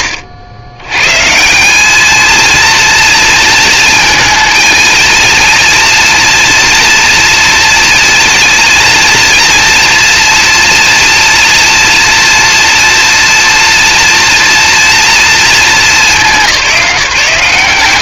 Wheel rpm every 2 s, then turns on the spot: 130, 230, 230, 230, 230, 240, 240, 230, 160.
none